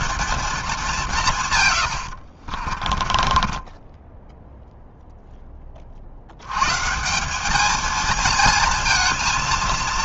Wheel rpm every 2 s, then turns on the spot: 210, 40, 0, 140, 230.
2-4